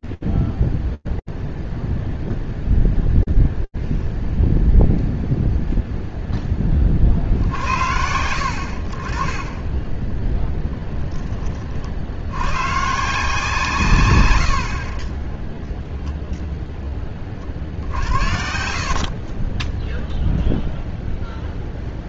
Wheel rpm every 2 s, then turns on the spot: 0, 0, 0, 40, 50, 10, 160, 20, 60, 20, 0.
14-16